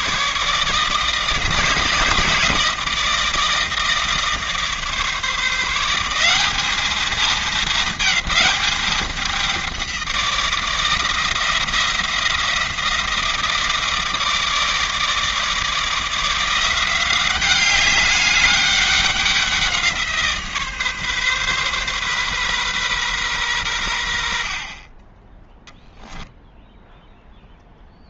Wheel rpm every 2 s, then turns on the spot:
160, 160, 150, 210, 210, 170, 170, 160, 180, 200, 150, 130, 40, 0.
none